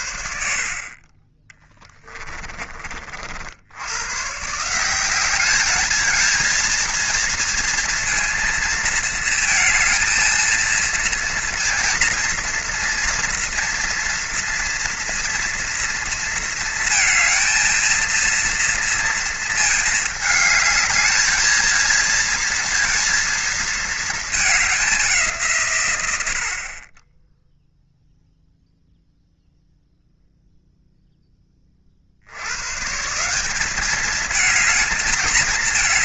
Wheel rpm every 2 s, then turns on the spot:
50, 30, 160, 230, 230, 230, 230, 240, 230, 230, 210, 230, 200, 30, 0, 0, 120, 220.
none